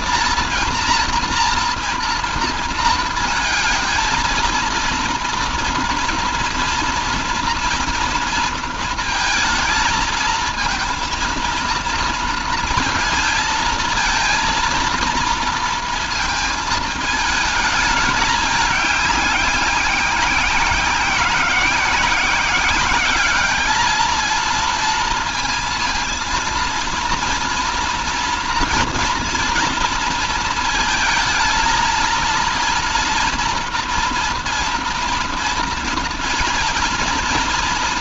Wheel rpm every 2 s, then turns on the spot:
230, 230, 230, 230, 230, 230, 230, 230, 220, 210, 180, 190, 230, 230, 230, 230, 230, 230, 230.
none